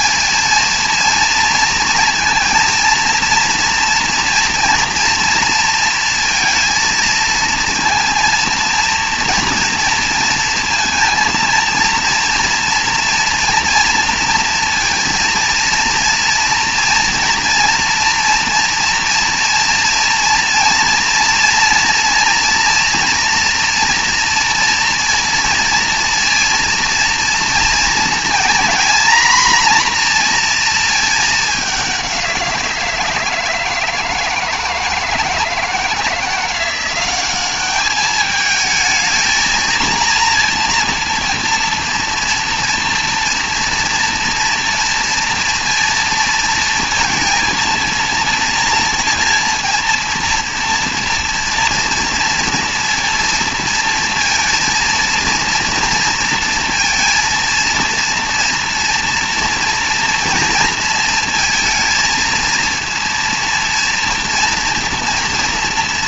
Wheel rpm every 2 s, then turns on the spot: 230, 230, 230, 230, 230, 230, 240, 230, 230, 230, 230, 230, 230, 230, 240, 230, 170, 160, 180, 220, 230, 230, 230, 220, 230, 230, 230, 230, 230, 230, 230, 230, 230.
none